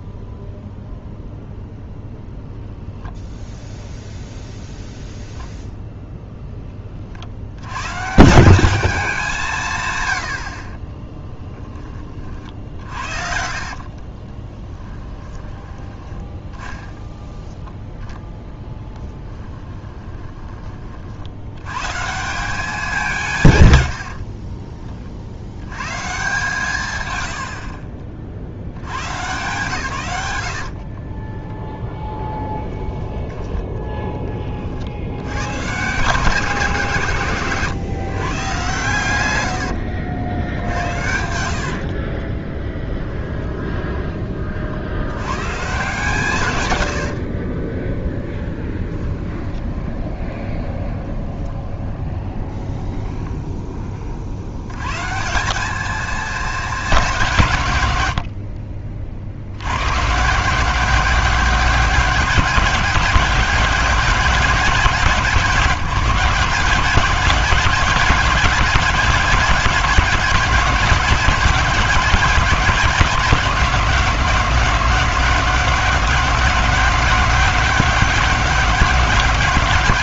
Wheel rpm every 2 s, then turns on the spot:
0, 0, 0, 30, 190, 30, 60, 20, 10, 10, 30, 190, 40, 140, 100, 50, 10, 60, 150, 130, 80, 20, 70, 110, 10, 20, 10, 120, 200, 40, 170, 180, 180, 180, 190, 190, 180, 170, 180, 190.
12-20 30-32 42-44 46-54